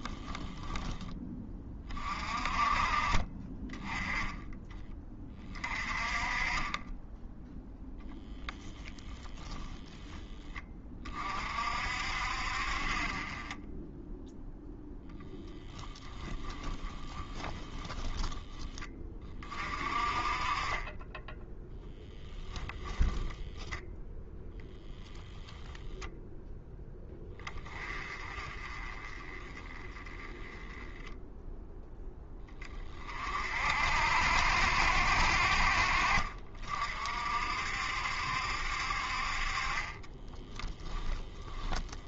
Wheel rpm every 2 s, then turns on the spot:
10, 30, 20, 10, 0, 30, 40, 0, 20, 20, 20, 10, 10, 10, 30, 10, 40, 60, 50, 60, 0.
16-18 22-26